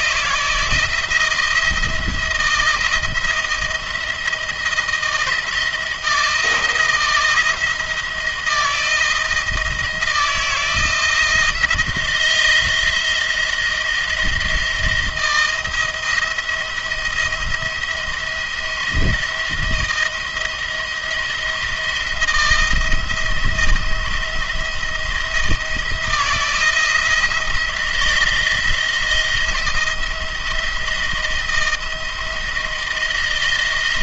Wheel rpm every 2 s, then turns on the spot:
170, 160, 160, 170, 160, 170, 170, 170, 170, 170, 170, 170, 170, 160, 160, 160, 160.
none